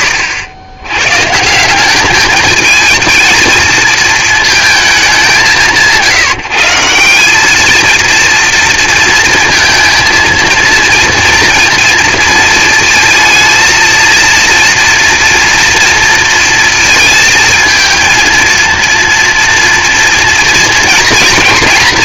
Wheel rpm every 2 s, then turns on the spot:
100, 210, 220, 160, 230, 230, 230, 230, 230, 230, 230.
none